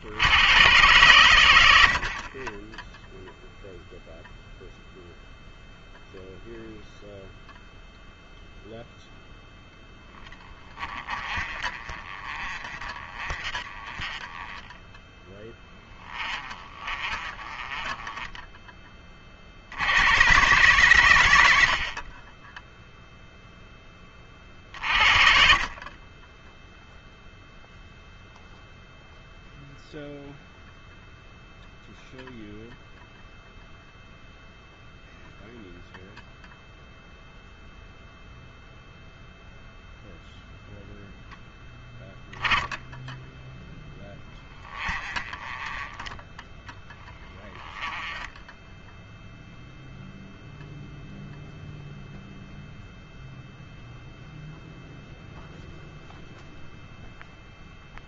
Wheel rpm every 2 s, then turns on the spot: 110, 10, 0, 0, 0, 20, 30, 10, 30, 20, 120, 10, 50, 0, 0, 0, 0, 0, 0, 0, 0, 10, 20, 10, 10, 0, 0, 0, 0.
10-18 44-50